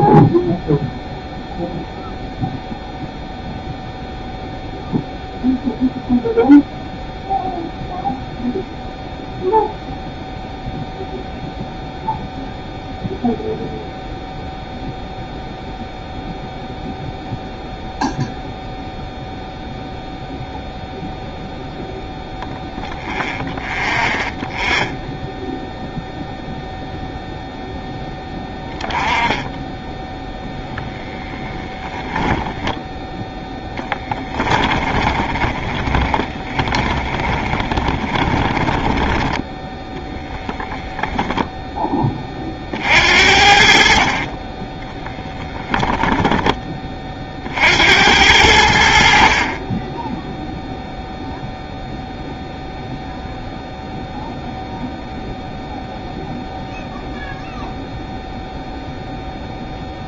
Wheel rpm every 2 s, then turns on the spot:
0, 0, 0, 0, 0, 0, 0, 0, 0, 0, 0, 0, 0, 0, 10, 20, 10, 20, 30, 10, 0, 50, 10, 20, 70, 0, 0, 0, 0, 0.
34-40